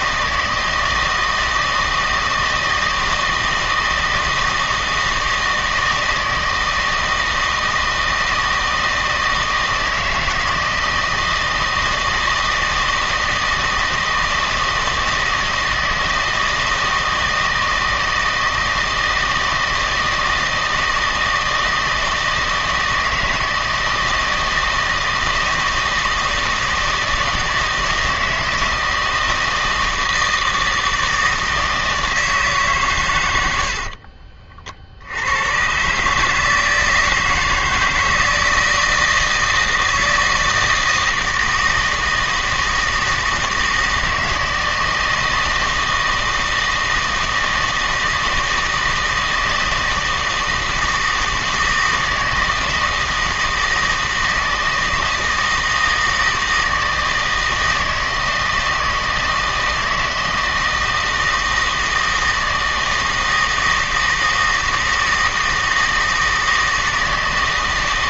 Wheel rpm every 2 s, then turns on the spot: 160, 160, 160, 160, 160, 160, 160, 160, 160, 160, 160, 160, 160, 160, 160, 160, 150, 40, 160, 160, 160, 160, 160, 160, 160, 160, 160, 160, 160, 160, 160, 160, 160, 160.
none